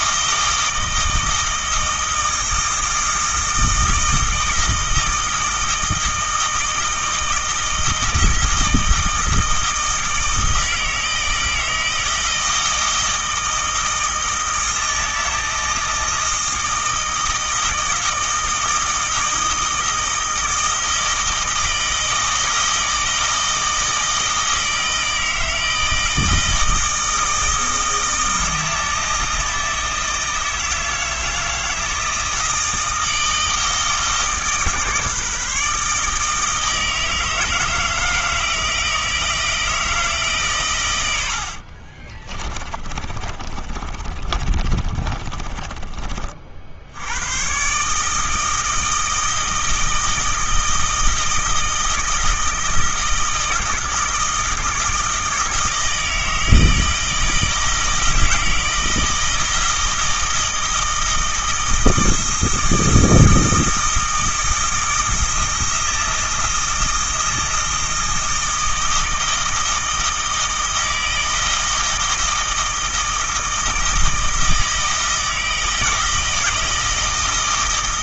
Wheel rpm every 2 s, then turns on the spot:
160, 160, 160, 160, 160, 160, 160, 160, 160, 160, 160, 160, 160, 160, 160, 160, 160, 150, 160, 160, 140, 30, 30, 60, 160, 160, 160, 160, 160, 160, 160, 160, 160, 160, 160, 160, 160, 160, 160.
42-46